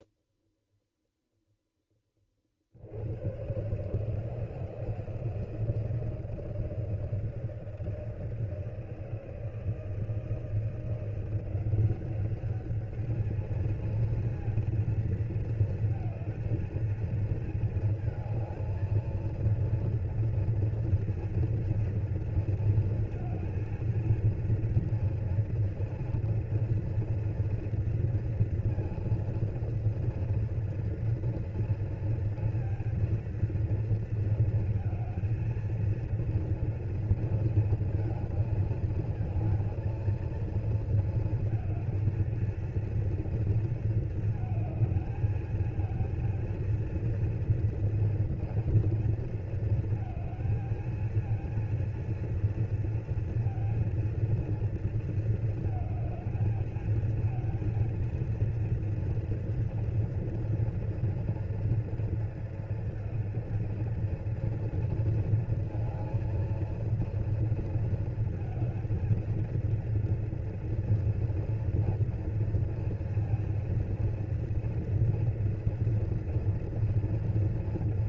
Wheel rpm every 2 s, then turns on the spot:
0, 50, 160, 160, 160, 160, 200, 230, 220, 230, 230, 230, 230, 240, 230, 230, 230, 230, 230, 220, 230, 230, 220, 230, 230, 220, 230, 230, 220, 230, 240, 230, 230, 230, 230, 230, 230, 230, 230.
none